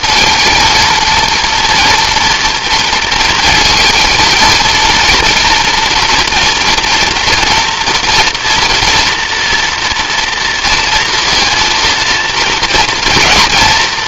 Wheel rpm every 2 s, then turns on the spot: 230, 230, 230, 230, 240, 230, 230.
none